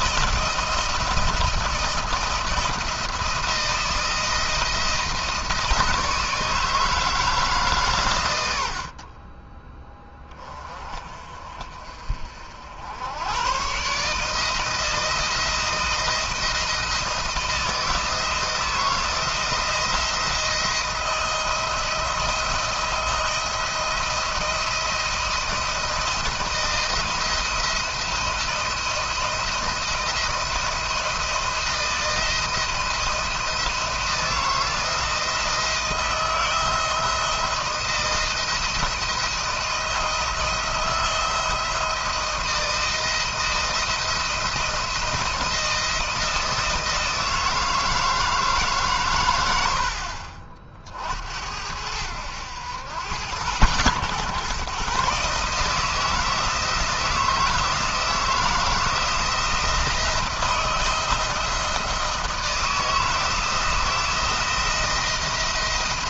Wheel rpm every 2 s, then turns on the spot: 170, 170, 170, 160, 90, 30, 70, 160, 170, 160, 170, 170, 170, 160, 160, 160, 160, 160, 160, 170, 170, 170, 170, 160, 140, 60, 100, 130, 160, 160, 170, 160, 170.
none